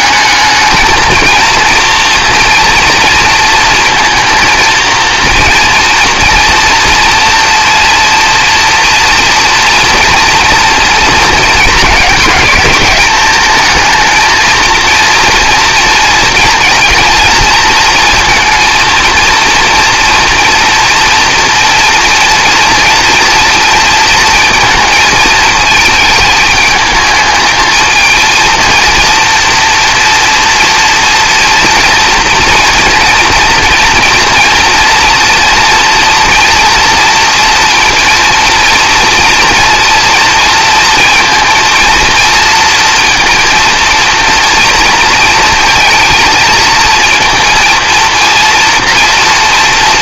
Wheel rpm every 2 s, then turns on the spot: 220, 230, 230, 230, 230, 230, 210, 230, 230, 230, 230, 230, 220, 220, 230, 240, 240, 240, 230, 230, 230, 230, 230, 230, 240.
none